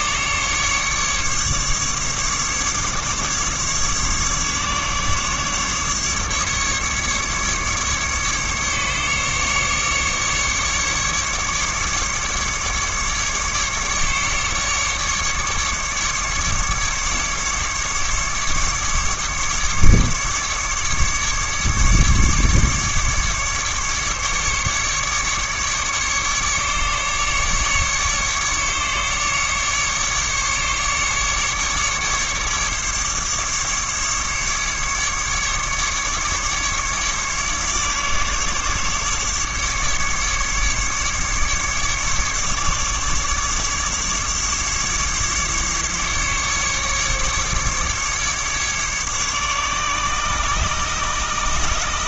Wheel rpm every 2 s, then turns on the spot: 140, 140, 140, 140, 140, 150, 150, 140, 140, 140, 150, 150, 140, 140, 150, 150, 150, 150, 150, 150, 150, 150, 150, 150, 150, 140.
none